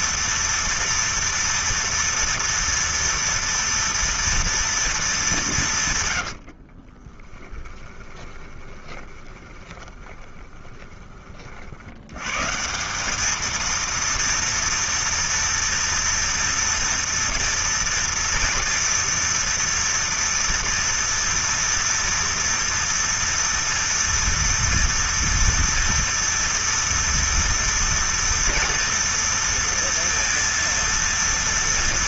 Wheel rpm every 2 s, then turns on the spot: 230, 230, 230, 40, 20, 20, 170, 230, 240, 240, 230, 230, 230, 230, 240, 230.
6-10